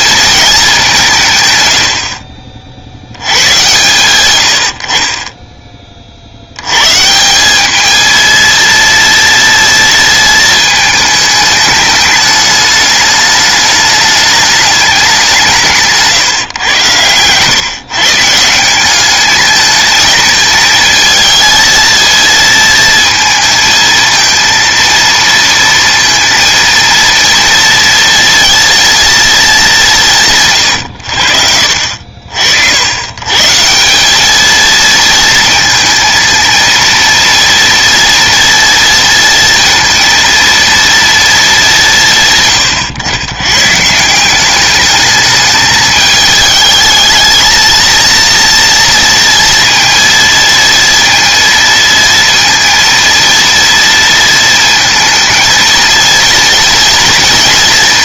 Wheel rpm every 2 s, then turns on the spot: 200, 70, 60, 110, 230, 220, 210, 210, 120, 180, 220, 230, 230, 230, 230, 130, 80, 220, 230, 230, 230, 130, 210, 210, 230, 230, 230, 220, 230.
none